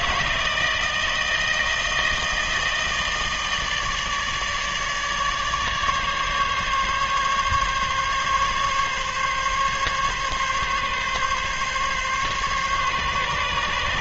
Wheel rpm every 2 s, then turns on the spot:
160, 160, 150, 140, 140, 140, 140.
none